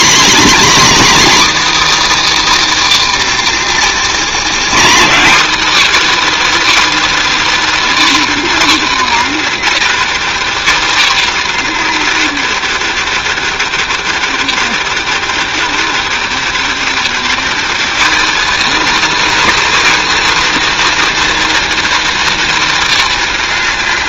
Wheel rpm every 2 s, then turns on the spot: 300, 310, 240, 320, 290, 260, 240, 230, 230, 300, 330, 310.
none